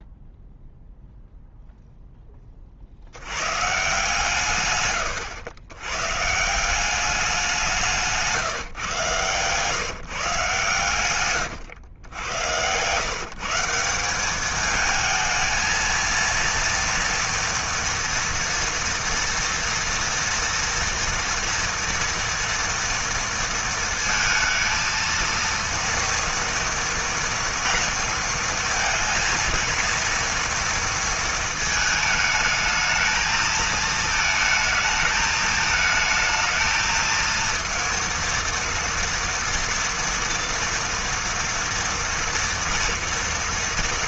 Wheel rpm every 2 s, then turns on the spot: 0, 70, 110, 190, 140, 120, 130, 220, 230, 230, 230, 230, 230, 230, 230, 230, 220, 220, 230, 230, 230, 230.
none